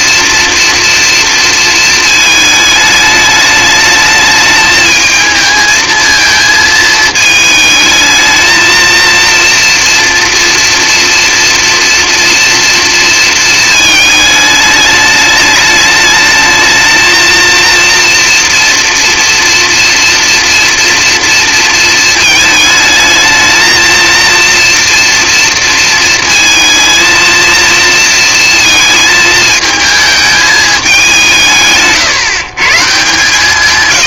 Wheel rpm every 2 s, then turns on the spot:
230, 210, 220, 220, 220, 230, 230, 210, 220, 230, 230, 220, 240, 230, 220, 200, 150.
none